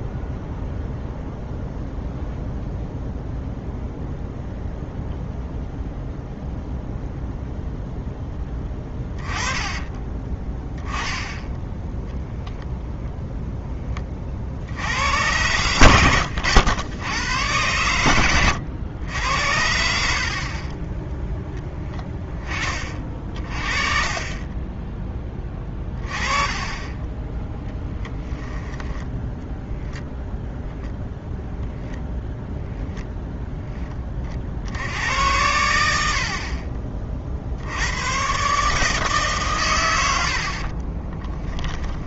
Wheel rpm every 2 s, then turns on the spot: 0, 0, 0, 0, 10, 10, 0, 80, 100, 90, 30, 30, 10, 20, 10, 0, 0, 60, 40, 150, 40.
8-10 24-30 40-42